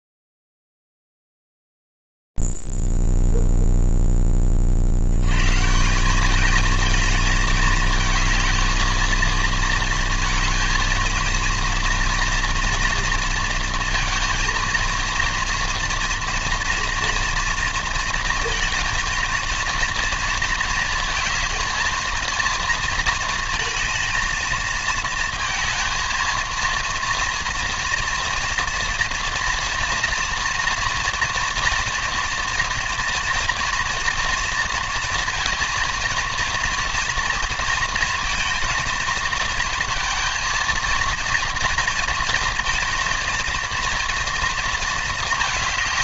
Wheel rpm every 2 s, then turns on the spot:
0, 0, 0, 180, 220, 230, 230, 230, 230, 230, 230, 230, 230, 230, 240, 230, 230, 230, 230, 230, 230, 230, 230.
none